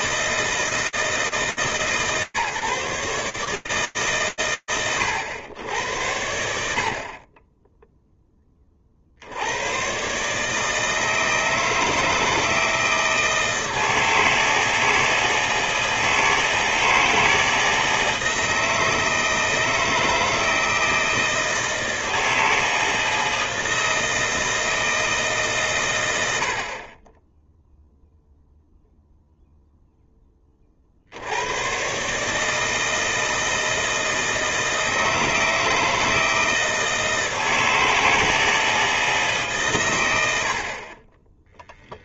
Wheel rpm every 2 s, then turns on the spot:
160, 150, 110, 80, 40, 160, 160, 160, 160, 160, 160, 160, 160, 50, 0, 90, 160, 160, 160, 140, 10.
none